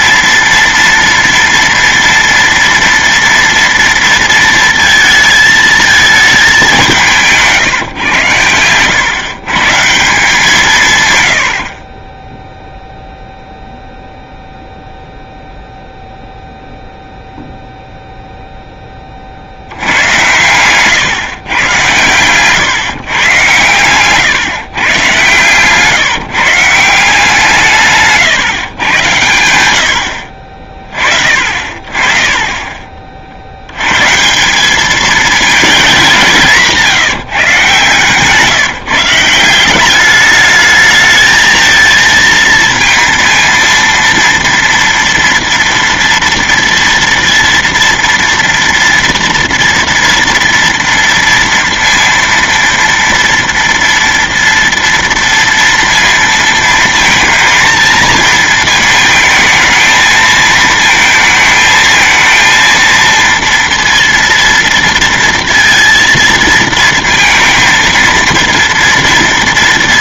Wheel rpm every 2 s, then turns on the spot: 230, 230, 230, 200, 120, 160, 0, 0, 0, 10, 110, 130, 130, 170, 130, 40, 30, 190, 170, 160, 210, 230, 230, 230, 230, 240, 230, 230, 230, 220, 220, 230, 230, 230, 230.
20-22 28-30 32-34